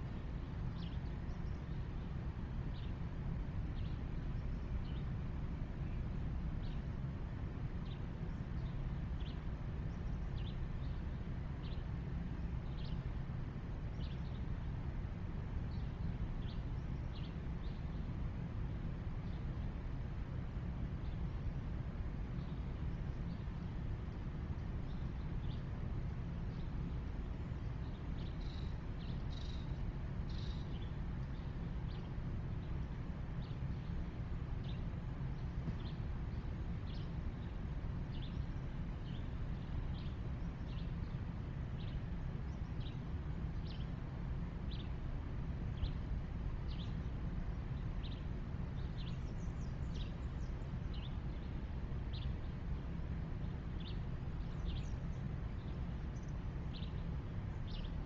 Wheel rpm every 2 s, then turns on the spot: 0, 0, 0, 0, 0, 0, 0, 0, 0, 0, 0, 0, 0, 0, 0, 0, 0, 0, 0, 0, 0, 0, 0, 0, 0, 0, 0, 0, 0.
none